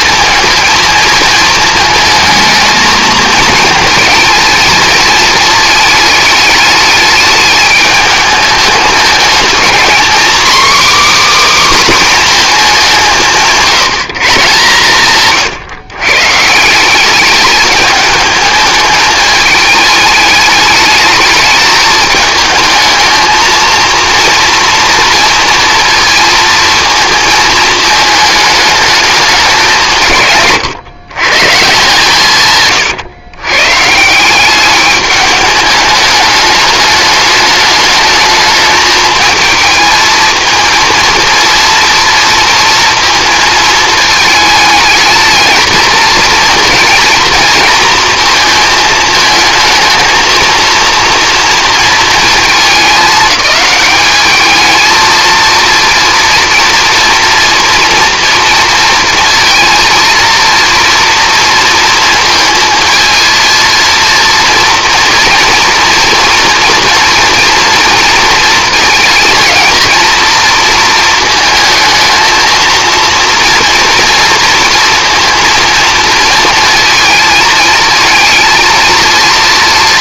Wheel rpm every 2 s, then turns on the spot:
220, 220, 220, 210, 210, 280, 200, 140, 180, 220, 210, 220, 230, 220, 210, 130, 130, 200, 210, 220, 230, 230, 220, 230, 220, 230, 220, 220, 240, 230, 230, 230, 240, 230, 230, 230, 230, 230, 230, 230.
none